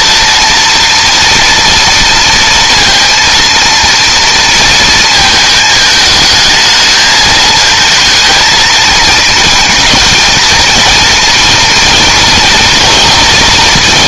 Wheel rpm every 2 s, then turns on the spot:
230, 230, 220, 220, 220, 230, 230.
none